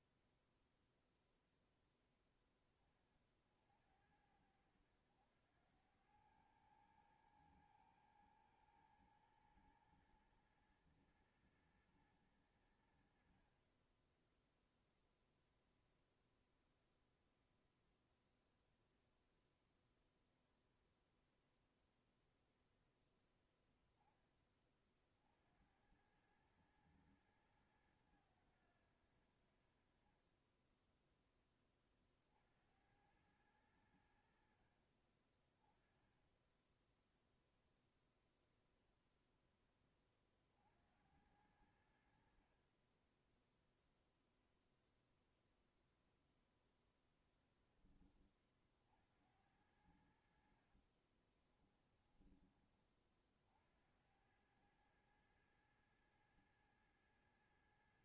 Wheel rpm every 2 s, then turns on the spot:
0, 10, 80, 100, 110, 110, 100, 10, 0, 0, 0, 0, 20, 100, 100, 30, 60, 70, 10, 0, 40, 50, 0, 0, 20, 60, 20, 90, 110.
50-52